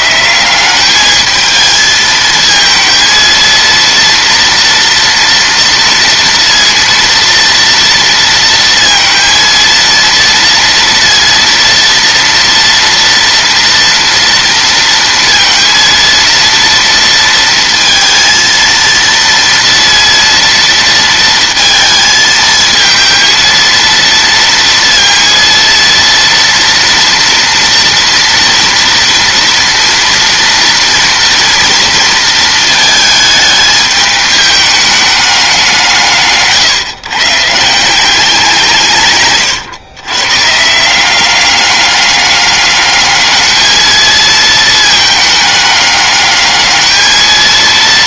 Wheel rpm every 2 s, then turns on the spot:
190, 230, 230, 230, 230, 230, 230, 230, 230, 230, 230, 220, 230, 230, 230, 230, 220, 210, 140, 170, 150, 200, 220, 210.
none